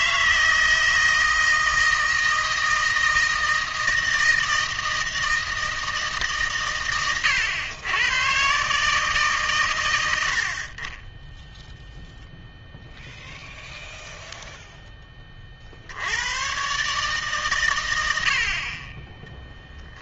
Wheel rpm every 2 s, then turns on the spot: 160, 160, 160, 120, 140, 40, 0, 0, 130, 30.
none